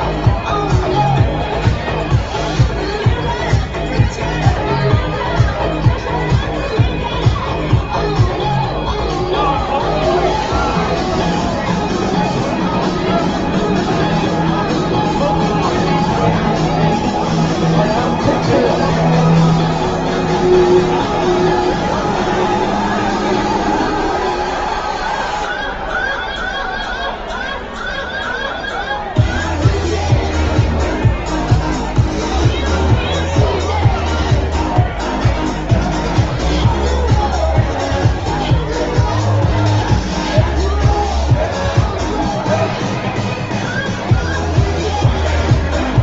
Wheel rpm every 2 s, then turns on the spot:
0, 0, 0, 0, 0, 0, 0, 0, 0, 0, 0, 0, 0, 0, 0, 0, 0, 0, 0, 0, 0, 0, 0.
none